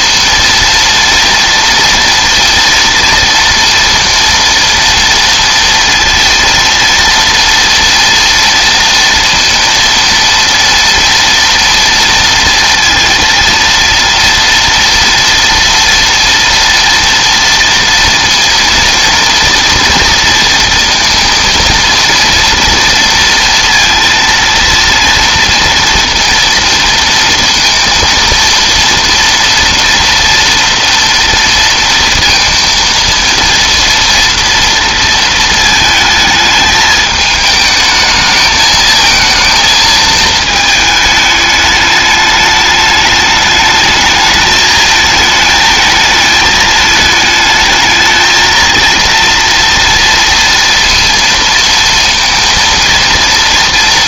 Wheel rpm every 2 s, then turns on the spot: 230, 230, 230, 230, 230, 230, 230, 230, 230, 230, 230, 230, 230, 230, 230, 230, 230, 230, 220, 220, 220, 210, 220, 210, 230, 230, 230.
none